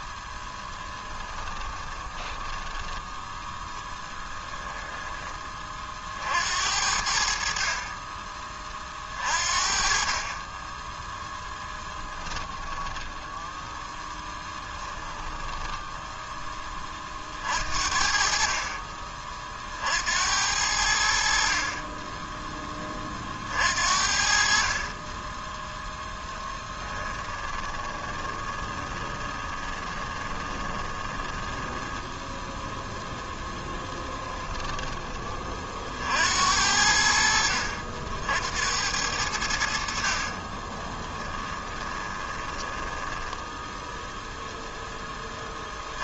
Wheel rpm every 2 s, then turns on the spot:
10, 10, 10, 70, 40, 10, 10, 10, 30, 40, 70, 30, 30, 10, 20, 20, 0, 10, 70, 90, 20, 10, 10.
0-4 14-16 26-32 40-44